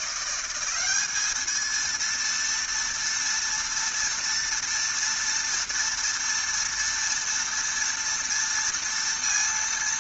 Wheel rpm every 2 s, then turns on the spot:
190, 230, 230, 230, 230.
none